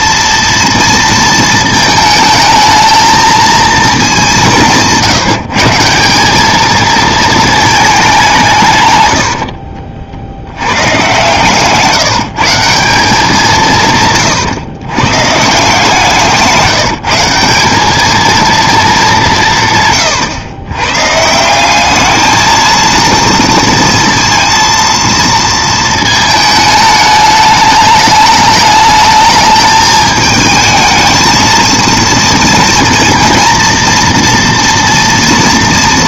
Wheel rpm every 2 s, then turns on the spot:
230, 220, 170, 210, 150, 100, 170, 120, 170, 220, 110, 230, 230, 210, 210, 220, 230, 230.
none